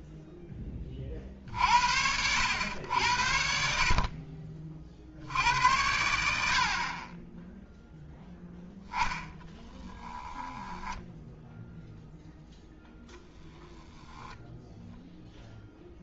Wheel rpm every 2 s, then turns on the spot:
20, 90, 50, 40, 0, 10, 0, 0.
none